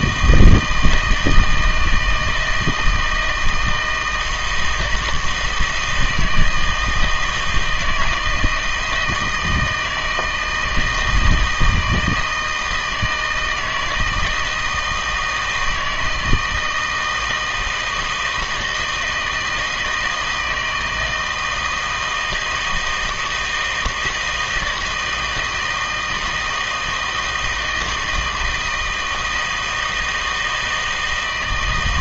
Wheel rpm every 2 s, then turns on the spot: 160, 160, 160, 160, 160, 160, 160, 160, 160, 160, 160, 160, 160, 160, 160, 160.
none